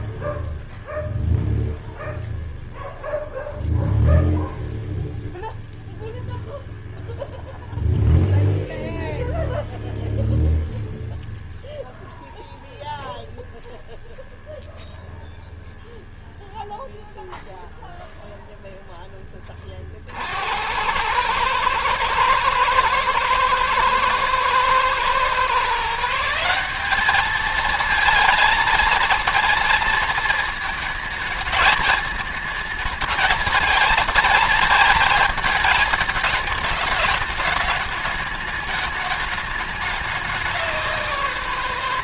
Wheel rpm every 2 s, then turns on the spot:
0, 0, 0, 0, 0, 0, 0, 0, 0, 0, 90, 110, 110, 180, 230, 220, 210, 220, 210, 210, 190.
none